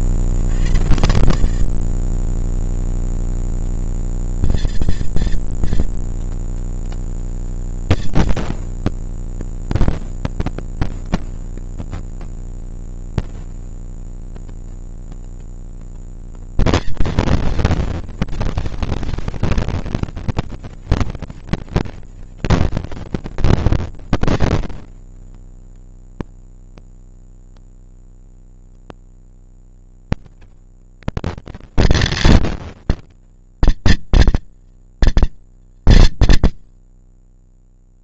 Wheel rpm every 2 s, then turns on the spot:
70, 160, 220, 230, 230, 230, 240, 230, 230, 240, 230, 230, 230, 230, 230, 230, 240, 230, 50.
none